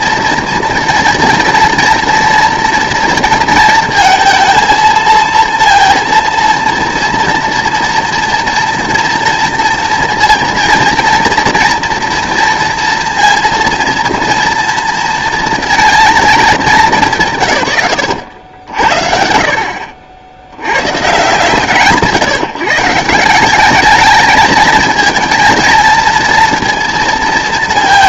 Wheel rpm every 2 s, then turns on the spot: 230, 230, 220, 230, 230, 230, 230, 230, 210, 80, 100, 160, 220, 230.
none